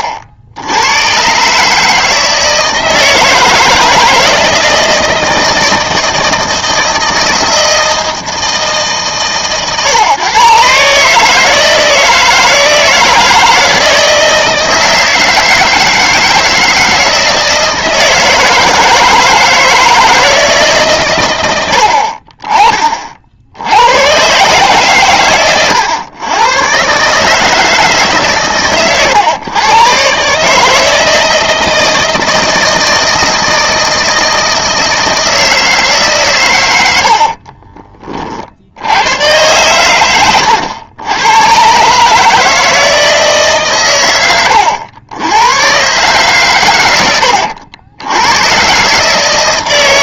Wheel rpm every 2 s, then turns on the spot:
80, 160, 160, 160, 160, 140, 170, 160, 160, 160, 150, 40, 130, 120, 130, 160, 160, 160, 110, 70, 100, 160, 90, 130, 120.
none